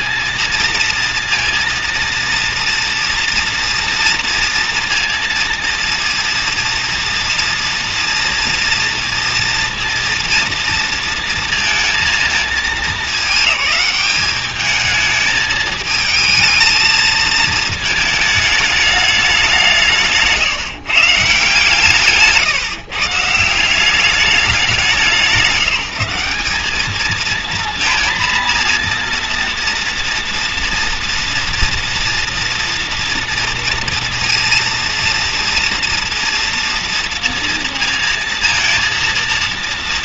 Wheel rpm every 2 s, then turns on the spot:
230, 230, 230, 230, 230, 230, 220, 210, 220, 220, 150, 150, 200, 200, 230, 230, 230, 230, 230, 230.
none